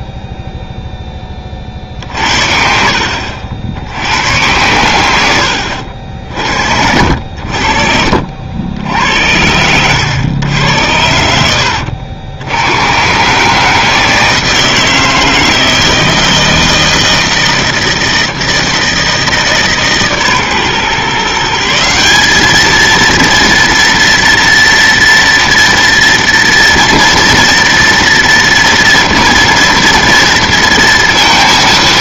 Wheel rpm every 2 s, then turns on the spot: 10, 60, 110, 50, 90, 100, 100, 160, 160, 160, 140, 210, 230, 230, 230, 230.
none